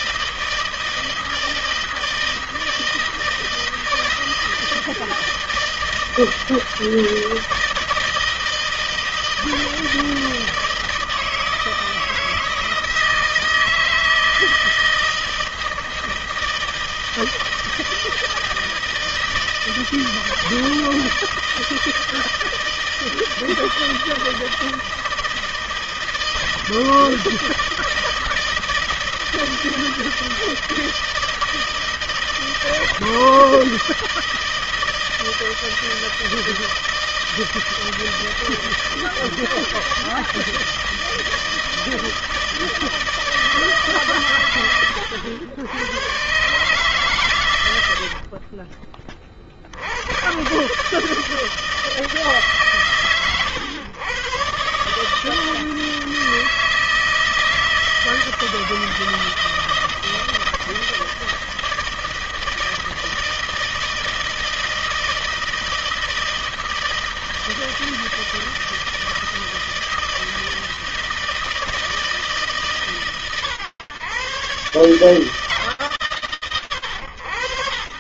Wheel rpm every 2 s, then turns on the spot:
160, 160, 160, 160, 160, 160, 160, 160, 160, 160, 160, 160, 160, 160, 160, 160, 160, 160, 160, 160, 160, 160, 130, 130, 60, 110, 150, 120, 160, 160, 160, 160, 160, 160, 160, 160, 150, 140, 90.
48-50